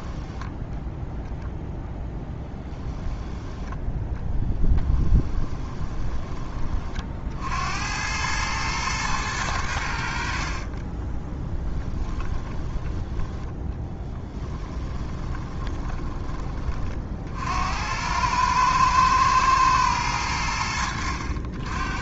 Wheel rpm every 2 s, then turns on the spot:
0, 10, 10, 40, 110, 20, 20, 20, 40, 110, 80.
4-6 10-12 14-16